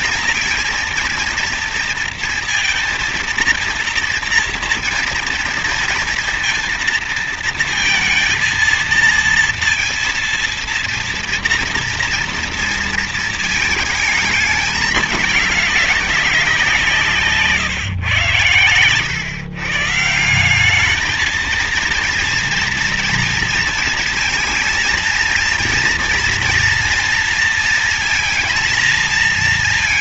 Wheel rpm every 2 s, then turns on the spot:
230, 230, 230, 230, 230, 230, 230, 210, 170, 120, 200, 230, 230, 230, 230.
none